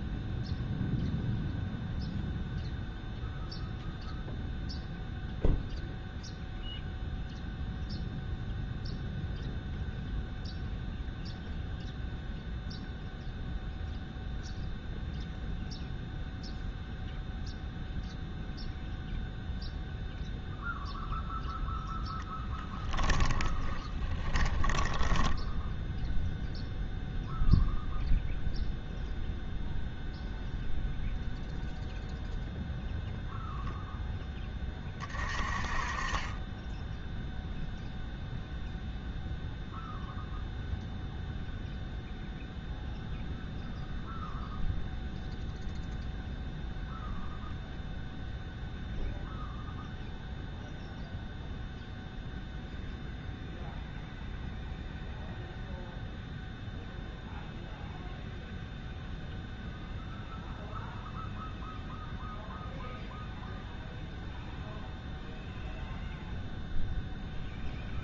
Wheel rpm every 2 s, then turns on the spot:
0, 0, 0, 0, 0, 0, 0, 0, 0, 0, 0, 10, 10, 0, 0, 0, 0, 20, 10, 0, 0, 0, 0, 0, 0, 0, 0, 0, 0, 0, 0, 0, 0, 0.
22-26